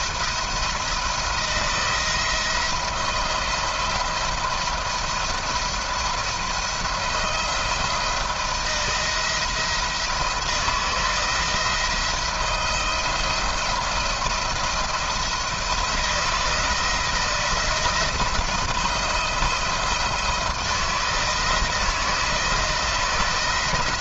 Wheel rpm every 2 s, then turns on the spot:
170, 170, 170, 170, 160, 160, 170, 170, 170, 160, 160, 160.
none